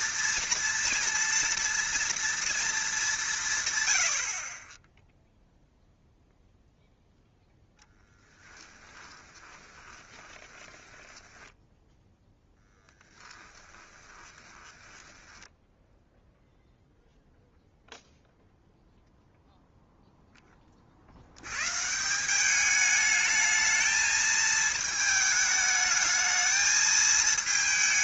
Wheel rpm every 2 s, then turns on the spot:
230, 220, 20, 0, 10, 20, 10, 20, 0, 0, 30, 210, 220, 220.
8-16